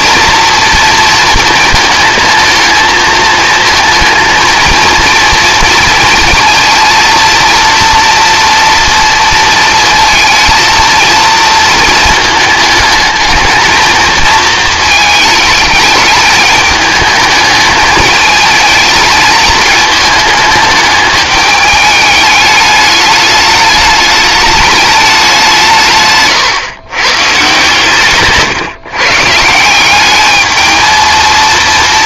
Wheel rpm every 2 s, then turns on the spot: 230, 220, 230, 230, 230, 230, 220, 220, 210, 220, 210, 210, 210, 130, 140, 220.
none